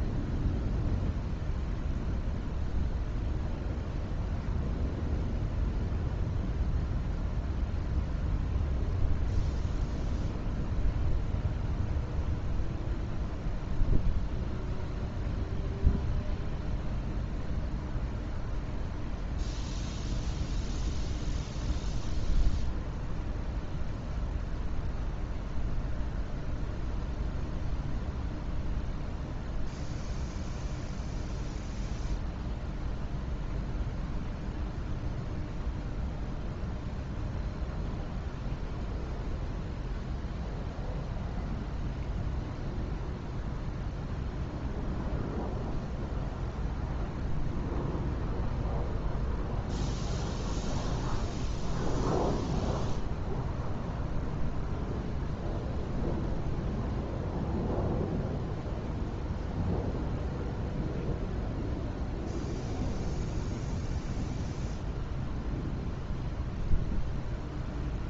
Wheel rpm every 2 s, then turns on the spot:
0, 0, 0, 0, 0, 0, 0, 0, 0, 0, 0, 0, 0, 0, 0, 0, 0, 0, 0, 0, 0, 0, 0, 0, 0, 0, 0, 0, 0, 0, 0, 0, 0, 0.
none